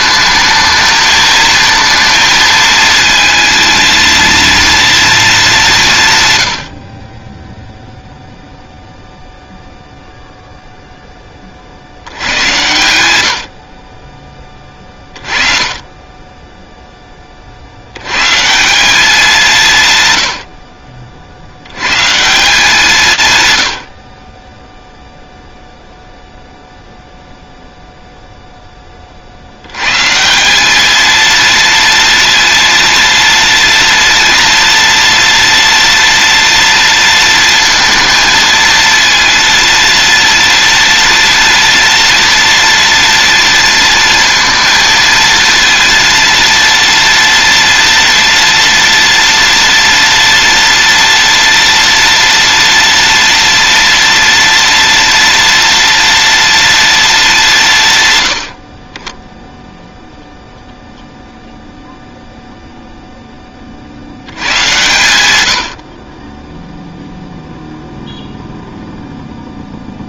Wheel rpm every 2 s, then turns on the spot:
220, 230, 230, 40, 0, 30, 70, 30, 40, 180, 70, 110, 0, 0, 70, 230, 230, 230, 230, 230, 230, 230, 230, 230, 230, 230, 230, 230, 200, 10, 0, 10, 100, 0, 0.
none